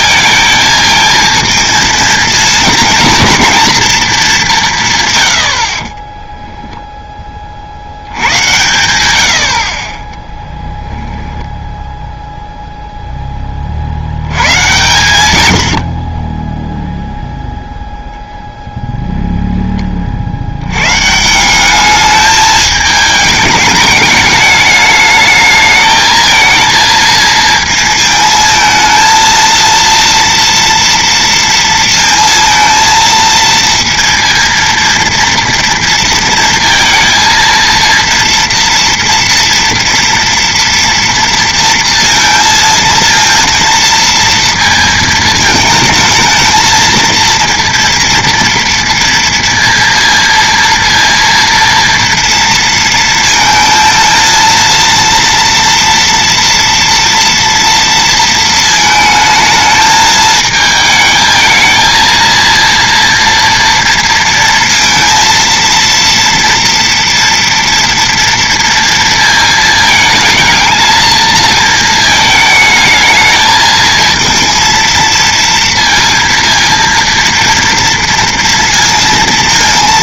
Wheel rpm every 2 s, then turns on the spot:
220, 230, 170, 0, 100, 10, 0, 120, 10, 0, 100, 210, 210, 230, 220, 230, 230, 230, 230, 230, 230, 230, 230, 220, 230, 230, 230, 230, 230, 220, 220, 230, 230, 240, 230, 230, 220, 230, 230, 230.
none